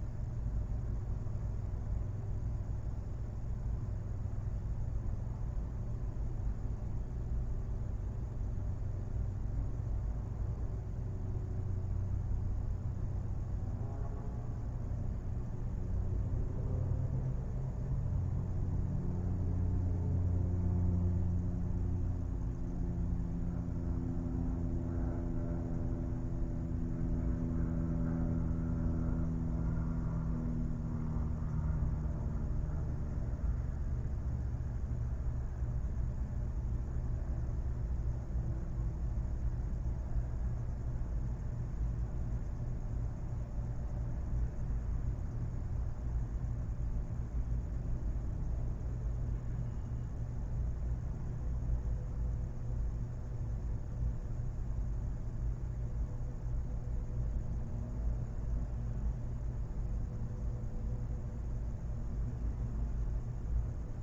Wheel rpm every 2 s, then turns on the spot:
0, 0, 0, 0, 0, 0, 0, 0, 0, 0, 0, 0, 0, 0, 0, 0, 0, 0, 0, 0, 0, 0, 0, 0, 0, 0, 0, 0, 0, 0, 0, 0.
none